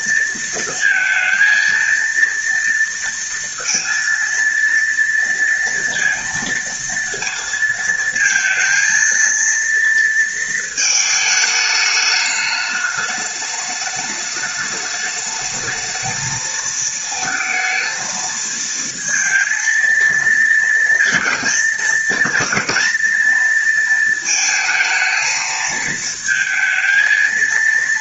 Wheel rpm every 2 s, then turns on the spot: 230, 230, 230, 230, 230, 220, 210, 210, 220, 220, 230, 230, 220, 220.
none